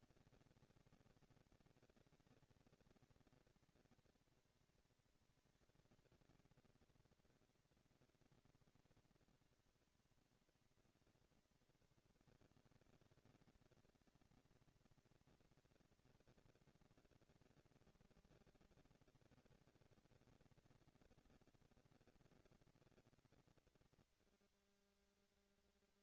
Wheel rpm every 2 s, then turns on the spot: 220, 230, 230, 230, 230, 230, 230, 230, 230, 230, 230, 230, 230.
none